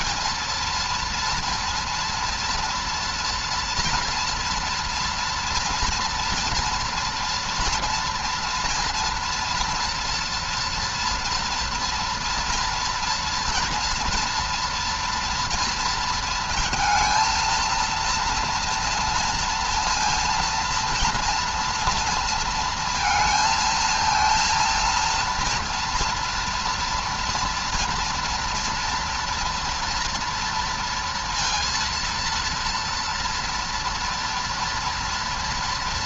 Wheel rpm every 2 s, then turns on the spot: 230, 230, 230, 230, 240, 230, 230, 230, 220, 230, 230, 230, 230, 230, 230, 230, 230, 230.
none